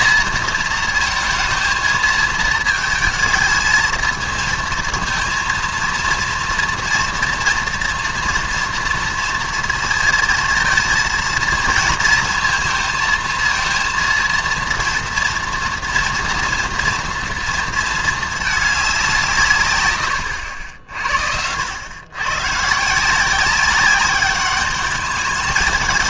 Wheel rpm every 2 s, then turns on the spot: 230, 220, 220, 230, 230, 220, 230, 230, 240, 220, 110, 110, 200.
none